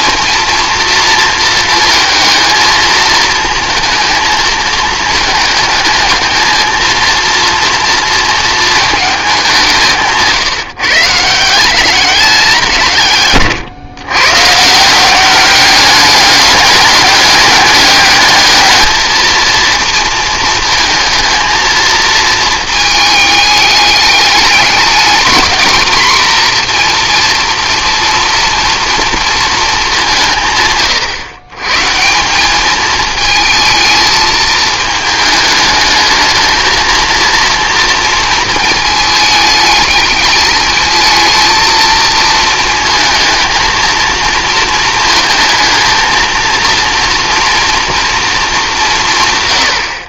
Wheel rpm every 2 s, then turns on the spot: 240, 230, 220, 230, 220, 150, 170, 150, 200, 220, 220, 220, 210, 240, 230, 130, 210, 220, 220, 220, 220, 220, 230, 230, 200.
none